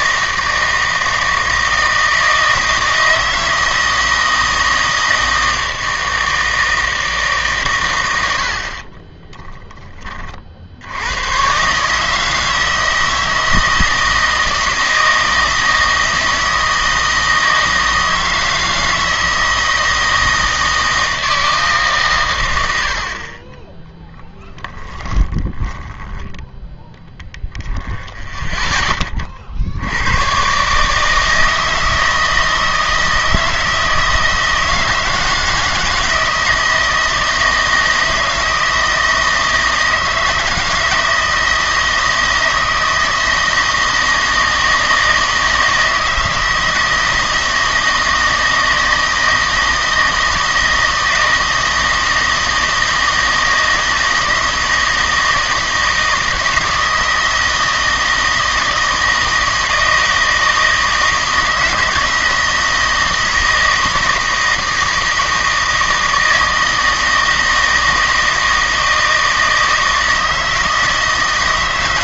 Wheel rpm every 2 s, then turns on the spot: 160, 160, 160, 160, 40, 80, 160, 160, 160, 160, 160, 80, 20, 10, 10, 150, 160, 160, 160, 160, 160, 160, 160, 160, 160, 160, 160, 160, 160, 160, 160, 170, 160, 160, 160, 160.
8-10 22-26